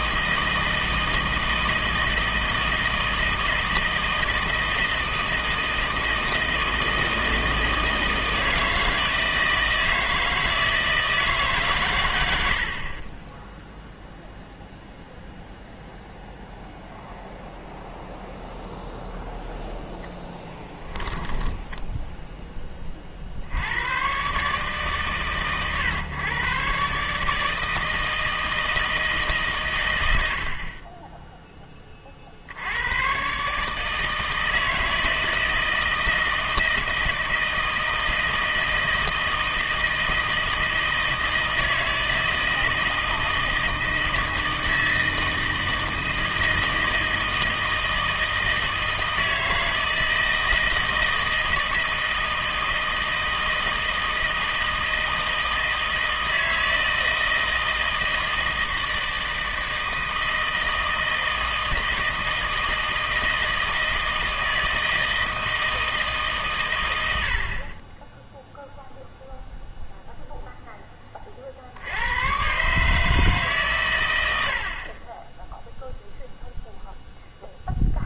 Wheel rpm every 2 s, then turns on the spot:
160, 160, 160, 160, 160, 160, 40, 0, 0, 0, 10, 30, 140, 140, 160, 30, 90, 160, 160, 160, 160, 160, 160, 160, 160, 160, 160, 160, 160, 160, 160, 160, 160, 100, 0, 10, 150, 40, 0.
20-22